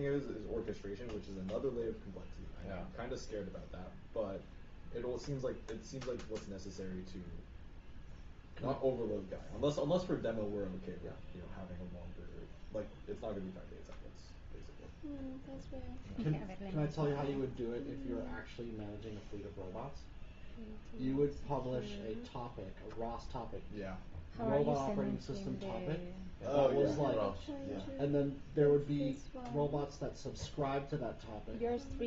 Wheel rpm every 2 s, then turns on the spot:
0, 0, 0, 0, 0, 0, 0, 0, 0, 0, 0, 0, 0, 0, 0, 0.
none